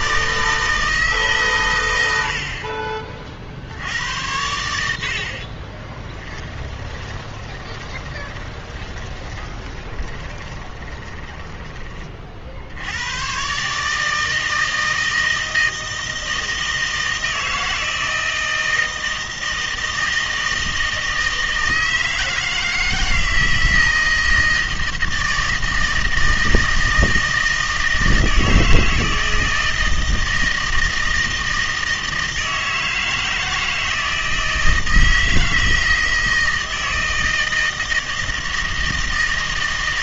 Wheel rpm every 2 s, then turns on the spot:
160, 40, 80, 20, 20, 10, 70, 160, 160, 160, 160, 160, 160, 160, 160, 160, 160, 160, 160, 160.
6-12